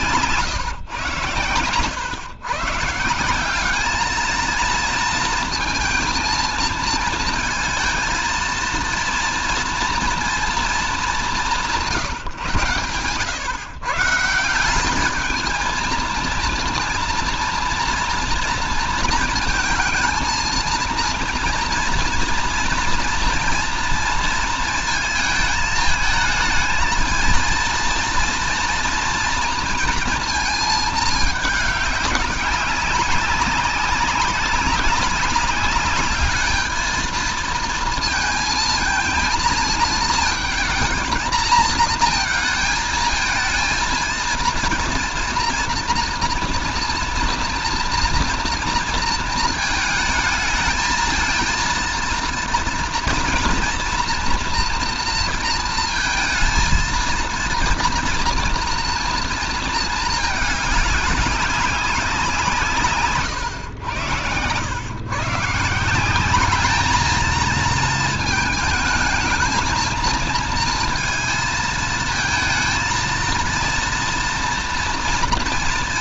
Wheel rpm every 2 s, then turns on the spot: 120, 140, 230, 230, 230, 210, 120, 190, 230, 230, 230, 230, 220, 220, 230, 220, 190, 190, 220, 230, 220, 220, 230, 230, 230, 220, 230, 230, 230, 230, 210, 150, 110, 210, 220, 230, 230, 230.
none